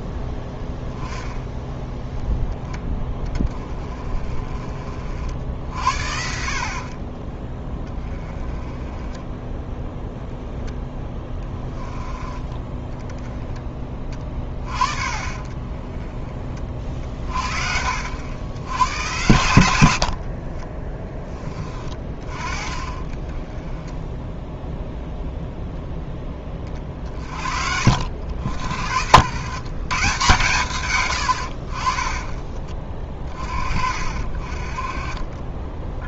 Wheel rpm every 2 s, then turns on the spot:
10, 10, 50, 50, 20, 10, 10, 30, 30, 100, 30, 30, 0, 30, 70, 120, 40, 40.
20-22